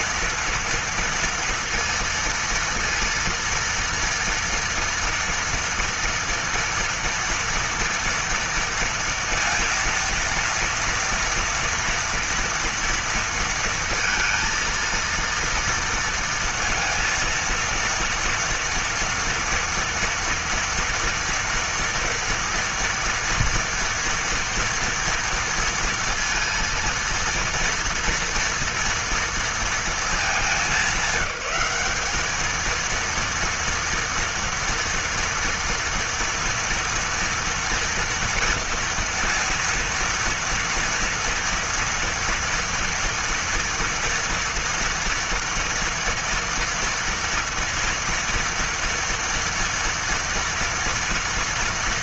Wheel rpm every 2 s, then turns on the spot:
230, 230, 230, 230, 230, 230, 230, 230, 230, 230, 230, 240, 230, 230, 230, 190, 220, 230, 230, 230, 240, 240, 230, 230, 240, 230.
none